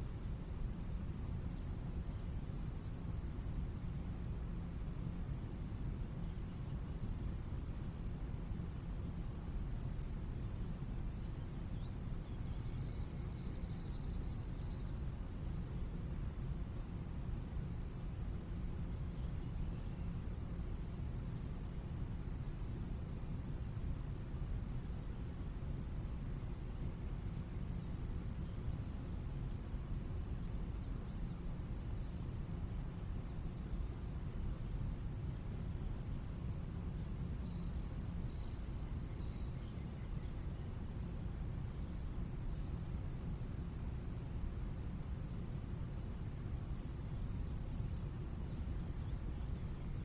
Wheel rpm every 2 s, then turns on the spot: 0, 0, 0, 0, 0, 0, 0, 0, 0, 0, 0, 0, 0, 0, 0, 0, 0, 0, 0, 0, 0, 0, 0, 0, 0.
none